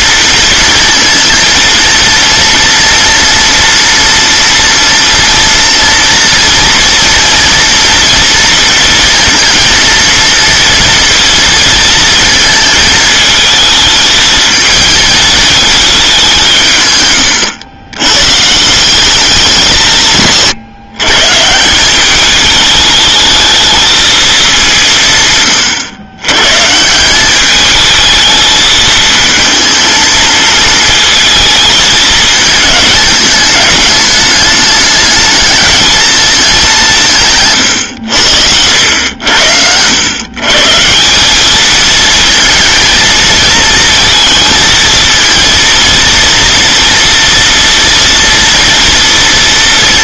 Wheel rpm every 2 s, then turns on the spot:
230, 230, 230, 230, 230, 230, 220, 220, 140, 160, 130, 210, 200, 140, 220, 220, 210, 210, 200, 90, 140, 220, 230, 230, 230.
none